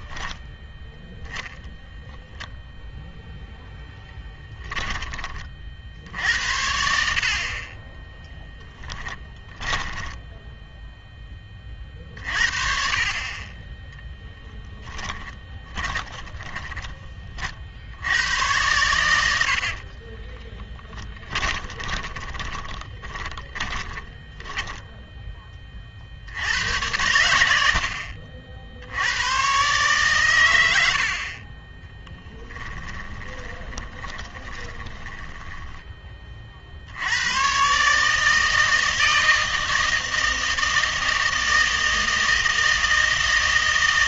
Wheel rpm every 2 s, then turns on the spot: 10, 0, 10, 80, 10, 10, 40, 10, 20, 100, 10, 20, 10, 90, 60, 100, 10, 10, 40, 160, 160, 160.
8-12 14-18 20-26 32-36